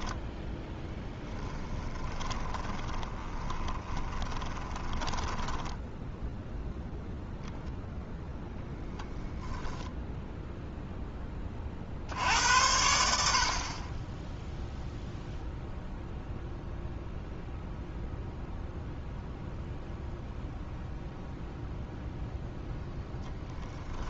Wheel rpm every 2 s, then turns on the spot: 10, 20, 20, 0, 0, 20, 60, 0, 0, 0, 0, 0.
2-6